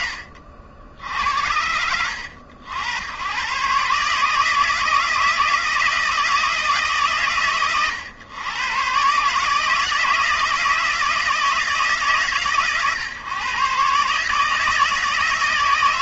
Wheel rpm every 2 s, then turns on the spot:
40, 110, 160, 130, 130, 160, 130, 140.
none